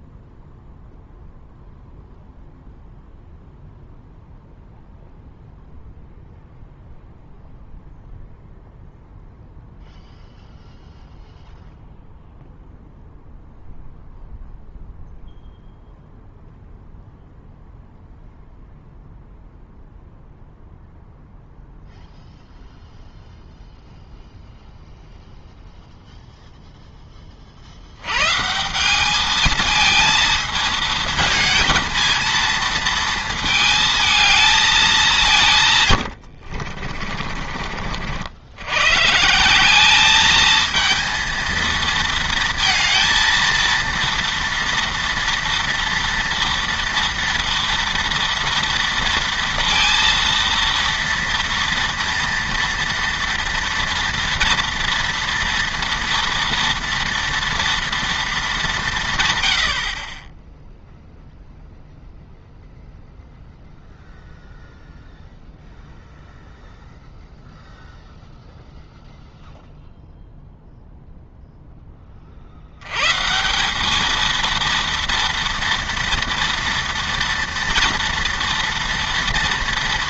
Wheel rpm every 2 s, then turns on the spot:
0, 0, 0, 0, 0, 0, 0, 0, 0, 0, 0, 0, 0, 0, 170, 220, 230, 210, 50, 110, 220, 230, 230, 230, 230, 230, 230, 230, 230, 180, 0, 0, 0, 0, 0, 0, 80, 230, 230, 230.
36-38